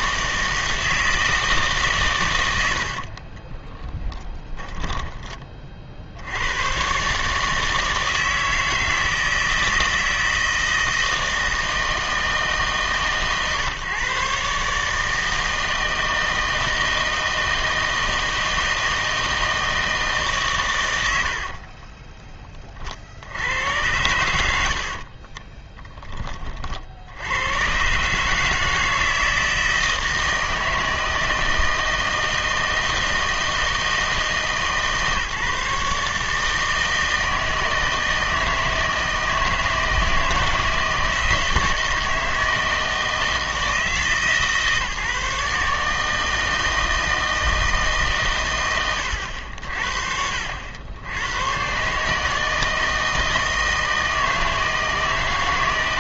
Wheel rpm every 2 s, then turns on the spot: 160, 80, 20, 120, 160, 160, 150, 150, 160, 160, 120, 40, 80, 40, 160, 160, 160, 150, 160, 160, 160, 160, 150, 160, 110, 70, 160, 160.
2-6 24-26